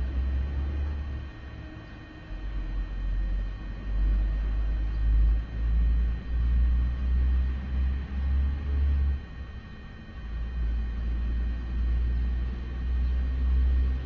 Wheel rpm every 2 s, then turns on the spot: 0, 0, 0, 0, 0, 0, 0.
none